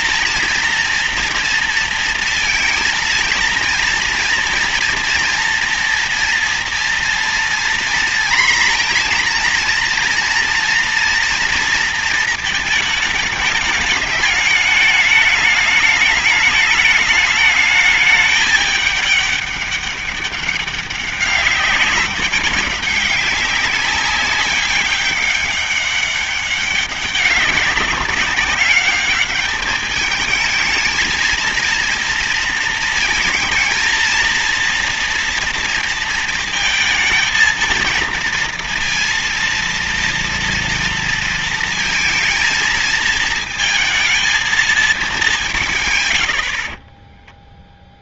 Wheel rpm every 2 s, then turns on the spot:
230, 230, 230, 230, 230, 230, 220, 210, 210, 210, 200, 200, 200, 200, 200, 220, 230, 230, 220, 230, 230, 230, 230, 50.
46-48